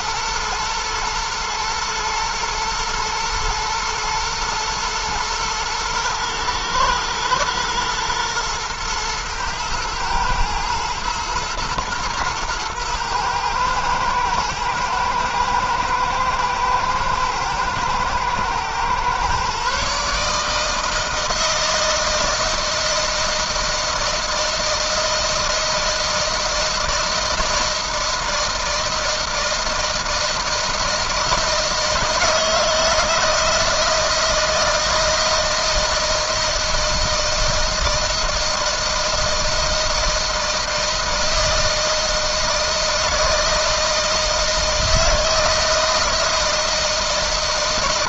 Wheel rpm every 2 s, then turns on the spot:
120, 120, 120, 110, 120, 120, 110, 120, 120, 130, 160, 160, 160, 160, 160, 160, 160, 160, 160, 160, 160, 160, 160, 160.
none